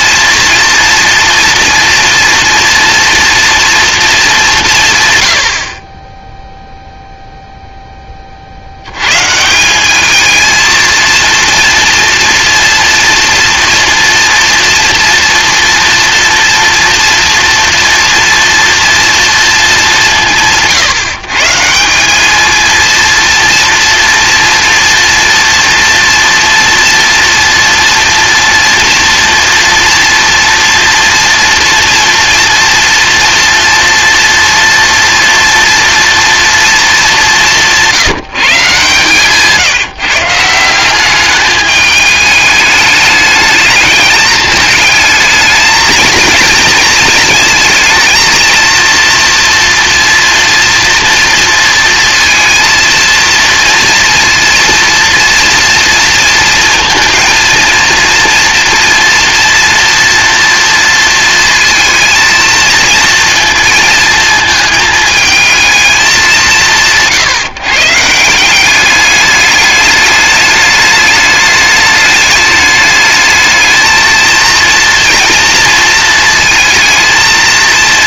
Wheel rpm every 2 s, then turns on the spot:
230, 230, 180, 0, 70, 220, 230, 240, 230, 230, 160, 220, 230, 240, 230, 230, 230, 230, 230, 140, 180, 210, 210, 220, 230, 230, 230, 230, 220, 230, 230, 230, 220, 180, 180, 210, 210, 230, 230.
none